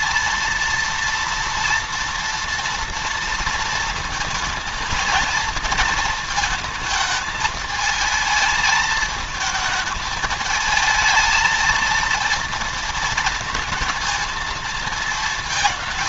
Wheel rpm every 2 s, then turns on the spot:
230, 230, 230, 220, 220, 220, 230, 230.
none